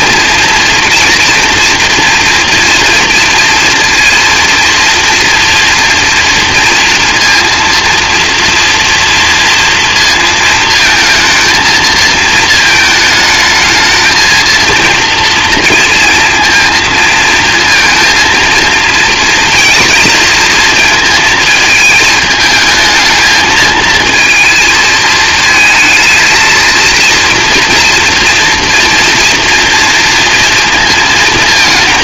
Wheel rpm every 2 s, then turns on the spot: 230, 230, 230, 240, 230, 230, 220, 230, 230, 230, 220, 220, 220, 230, 230, 230.
none